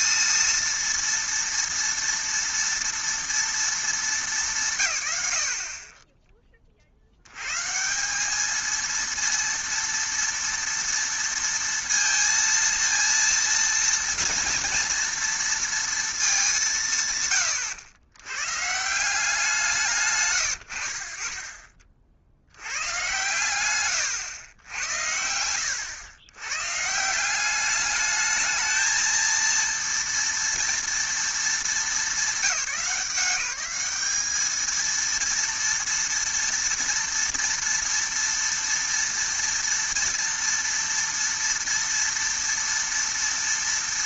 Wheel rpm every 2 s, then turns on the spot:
230, 230, 140, 40, 220, 230, 230, 230, 170, 150, 50, 90, 100, 130, 220, 230, 190, 220, 230, 230, 230, 230.
none